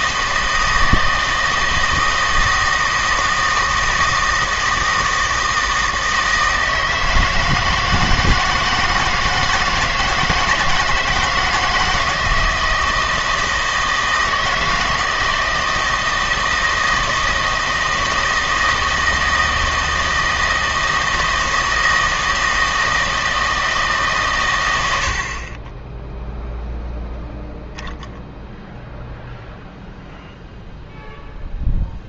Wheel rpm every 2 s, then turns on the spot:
160, 160, 160, 160, 160, 160, 160, 160, 160, 160, 160, 160, 100, 0, 0, 0.
none